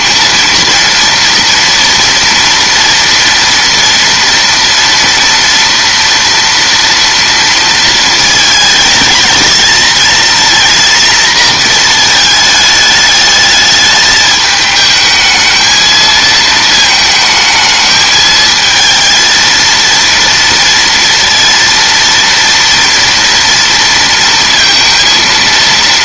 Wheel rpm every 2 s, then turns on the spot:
230, 230, 240, 230, 220, 240, 220, 220, 230, 220, 230, 230, 230.
none